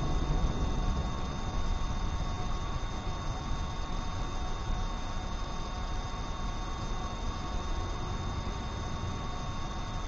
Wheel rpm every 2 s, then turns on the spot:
0, 0, 0, 0, 0.
none